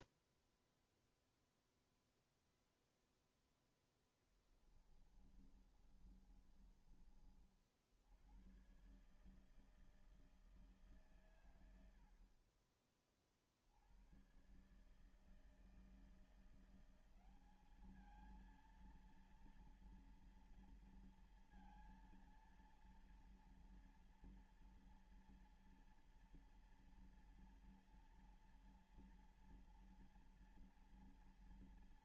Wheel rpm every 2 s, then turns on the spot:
0, 0, 10, 30, 90, 160, 60, 110, 170, 220, 230, 230, 230, 230, 230, 230.
4-8